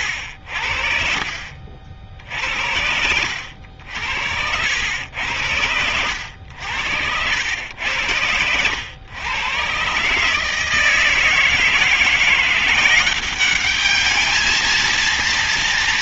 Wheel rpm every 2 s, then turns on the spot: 70, 70, 70, 80, 100, 160, 180, 220.
none